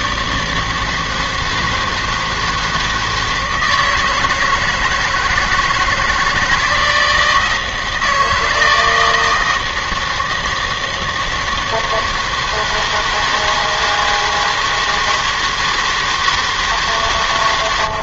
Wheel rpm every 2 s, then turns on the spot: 160, 160, 160, 160, 160, 160, 160, 160, 150.
none